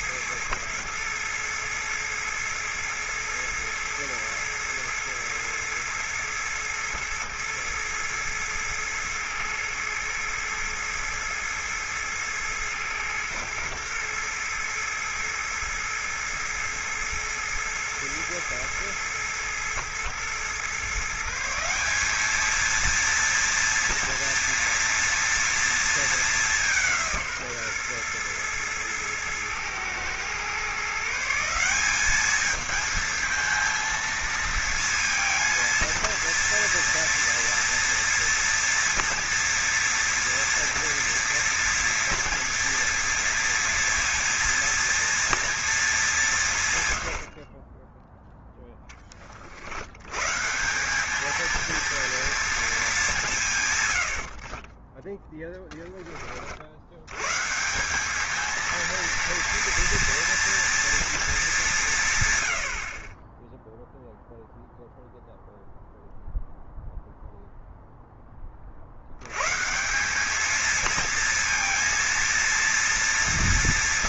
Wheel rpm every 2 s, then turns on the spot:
110, 110, 110, 110, 110, 110, 110, 110, 110, 110, 130, 220, 230, 180, 110, 140, 220, 230, 230, 230, 230, 240, 230, 130, 10, 180, 210, 20, 80, 230, 240, 70, 0, 0, 70, 220, 230.
none